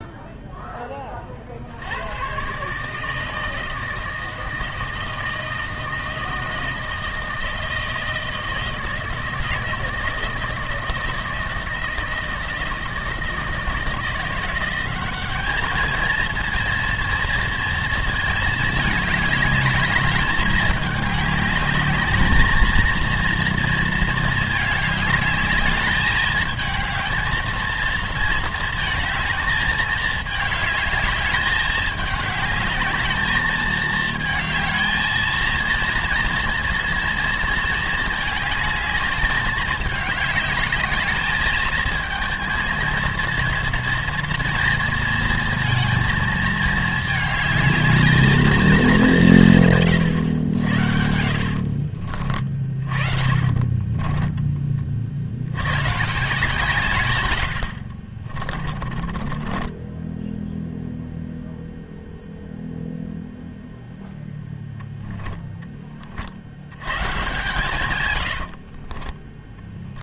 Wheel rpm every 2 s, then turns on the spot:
30, 160, 160, 160, 160, 160, 160, 200, 230, 210, 210, 230, 210, 220, 220, 210, 210, 220, 230, 210, 220, 230, 220, 220, 180, 80, 40, 60, 100, 20, 0, 0, 10, 130, 20.
50-54 58-60 64-66 68-70